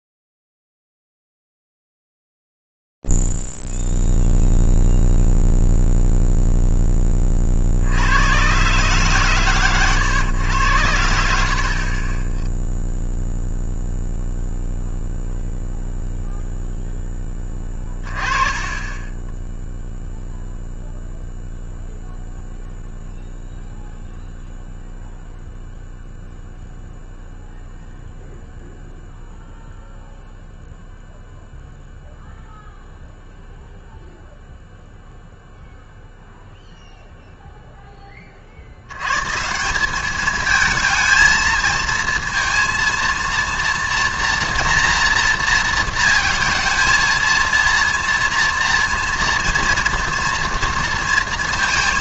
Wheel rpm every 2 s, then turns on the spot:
0, 0, 0, 0, 70, 120, 30, 0, 0, 20, 0, 0, 0, 0, 0, 0, 0, 0, 0, 70, 220, 230, 240, 220, 230, 230.
none